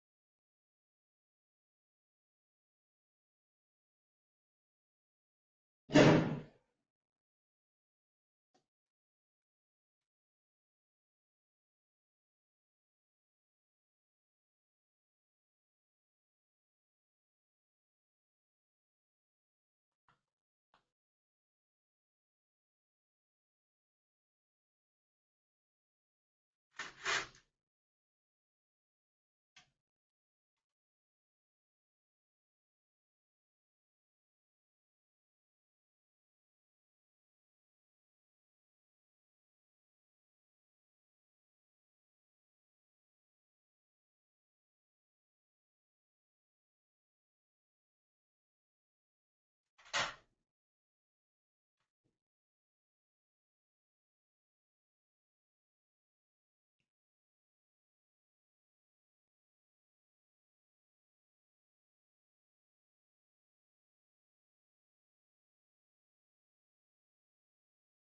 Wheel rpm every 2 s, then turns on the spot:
0, 0, 0, 0, 0, 0, 0, 0, 0, 0, 0, 0, 0, 0, 0, 0, 0, 0, 0, 0, 0, 0, 0, 0, 0, 0, 0, 0, 0, 0, 0, 0, 0, 0.
none